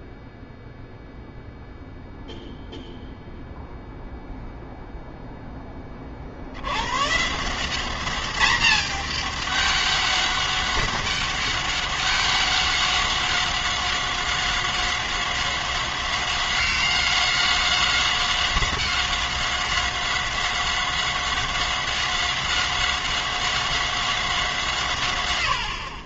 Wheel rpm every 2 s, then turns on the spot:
0, 0, 0, 80, 200, 200, 200, 190, 190, 190, 190, 190, 160.
none